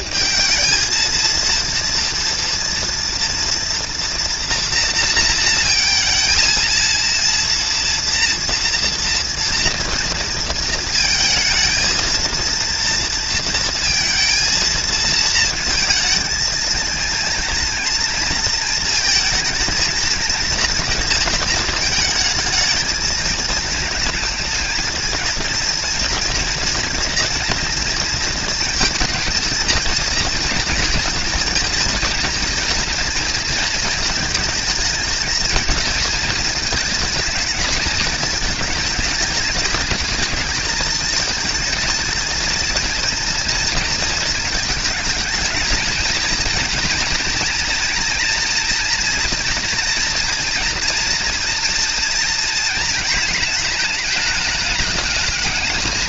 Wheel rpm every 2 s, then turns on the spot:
220, 240, 230, 230, 230, 230, 230, 230, 230, 230, 230, 220, 220, 240, 230, 230, 230, 220, 220, 220, 220, 230, 220, 240, 240, 230, 230, 210.
none